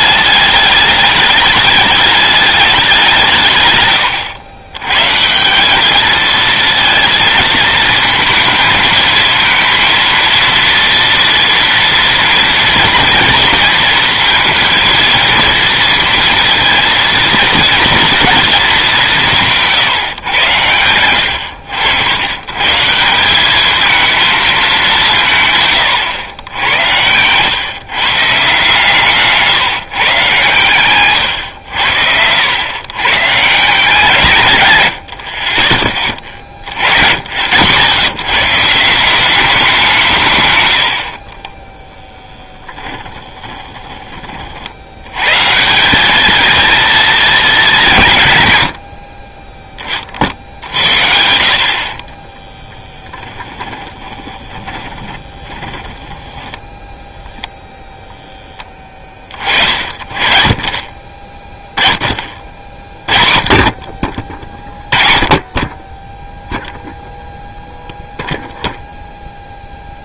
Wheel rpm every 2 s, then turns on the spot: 210, 200, 110, 220, 220, 230, 230, 230, 230, 220, 100, 130, 200, 90, 140, 110, 100, 120, 50, 150, 110, 10, 50, 230, 90, 60, 10, 20, 10, 10, 30, 40, 30, 0, 0.
42-44 52-56